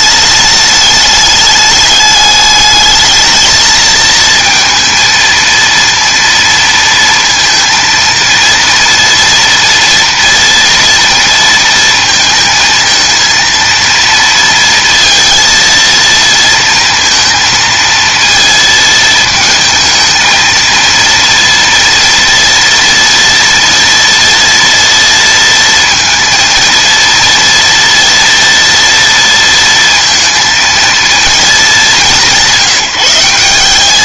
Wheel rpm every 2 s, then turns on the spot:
210, 210, 230, 230, 230, 230, 230, 230, 230, 220, 230, 230, 230, 230, 230, 230, 170.
none